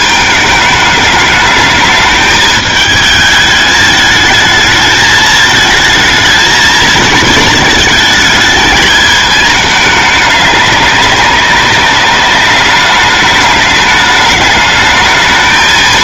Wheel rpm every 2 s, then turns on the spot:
210, 210, 220, 220, 220, 200, 210, 220.
none